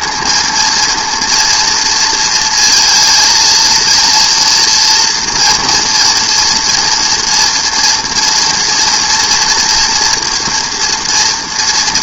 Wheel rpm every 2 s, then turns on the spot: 230, 230, 230, 230, 230, 240.
none